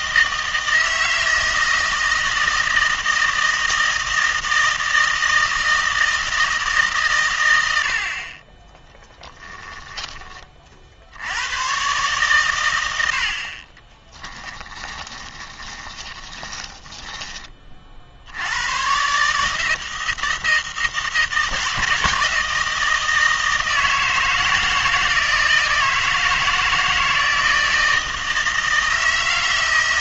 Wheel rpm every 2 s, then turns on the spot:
160, 160, 160, 160, 20, 40, 100, 20, 10, 110, 160, 160, 160, 160, 160.
14-18